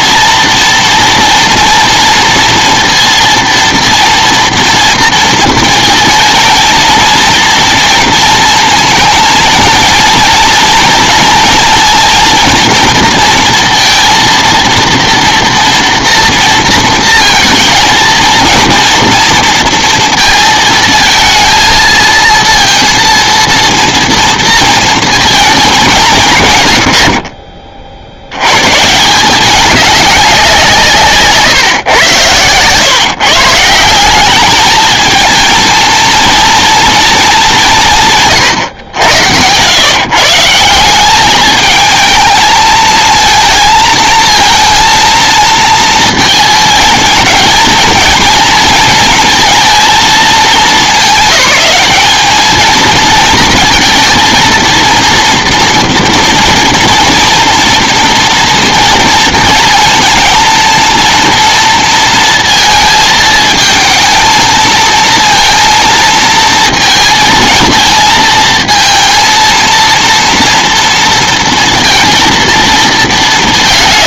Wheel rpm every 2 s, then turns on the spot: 230, 230, 230, 230, 230, 230, 230, 230, 230, 230, 220, 230, 230, 120, 110, 180, 120, 210, 230, 120, 160, 220, 230, 220, 220, 200, 220, 230, 230, 230, 230, 230, 220, 230, 220, 230, 230.
none